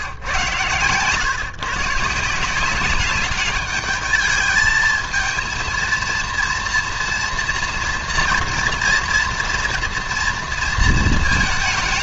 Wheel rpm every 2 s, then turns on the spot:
110, 180, 220, 230, 230, 230.
none